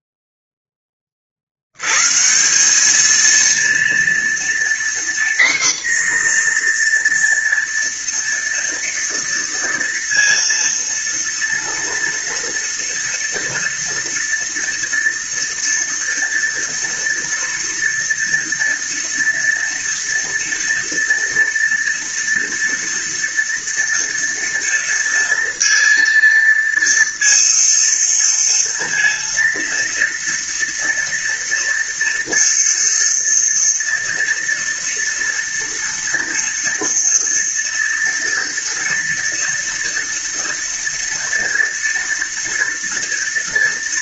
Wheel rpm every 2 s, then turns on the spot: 20, 200, 240, 240, 230, 230, 230, 230, 230, 230, 230, 230, 230, 230, 230, 230, 230, 230, 230, 230, 230, 230.
none